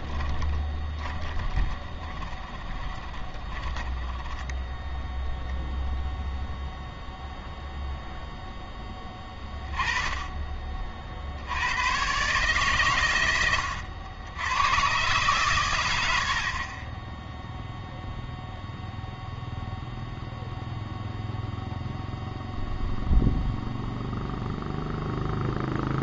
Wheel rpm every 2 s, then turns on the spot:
20, 20, 10, 0, 10, 40, 130, 110, 40, 0, 0, 0, 0.
0-4